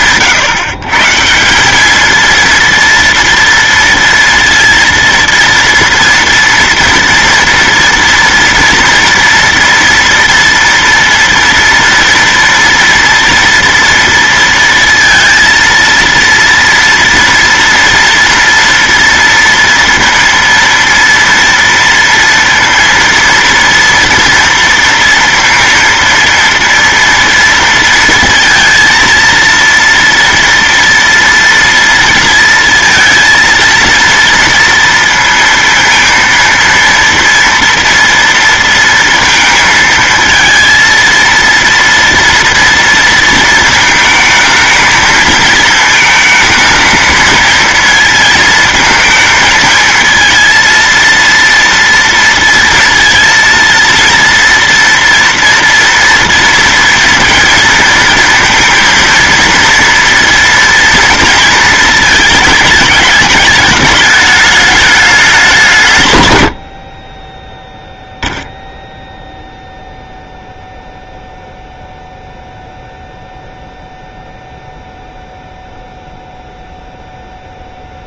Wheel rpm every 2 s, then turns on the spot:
150, 230, 230, 230, 240, 240, 230, 230, 230, 230, 230, 230, 230, 230, 230, 230, 230, 230, 230, 230, 230, 230, 220, 220, 220, 230, 230, 230, 230, 230, 230, 210, 210, 40, 0, 0, 0, 0, 0.
none